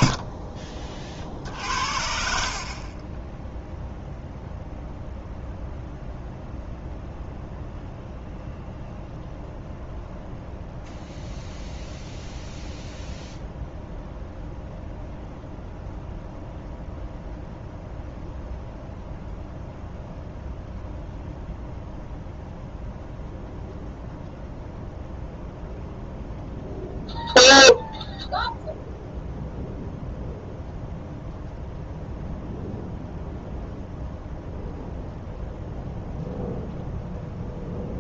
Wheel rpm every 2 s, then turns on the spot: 40, 30, 0, 0, 0, 0, 0, 0, 0, 0, 0, 0, 0, 0, 0, 0, 0, 0, 0.
2-4